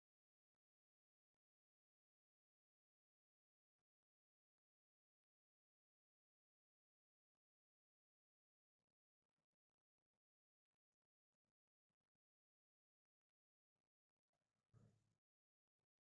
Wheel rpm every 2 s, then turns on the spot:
0, 0, 0, 0, 0, 0, 0, 0.
none